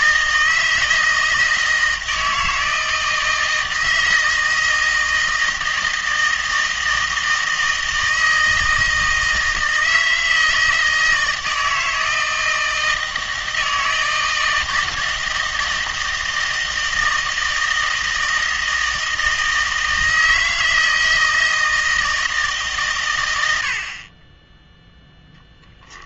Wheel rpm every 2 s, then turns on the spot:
160, 160, 160, 160, 160, 160, 160, 160, 160, 160, 160, 140, 10.
none